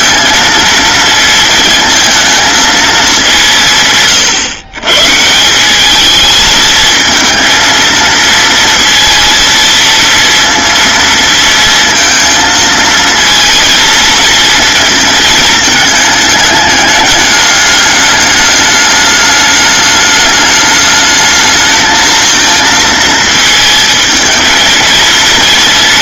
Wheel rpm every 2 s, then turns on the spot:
230, 220, 130, 220, 230, 230, 230, 230, 210, 210, 210, 220, 220.
none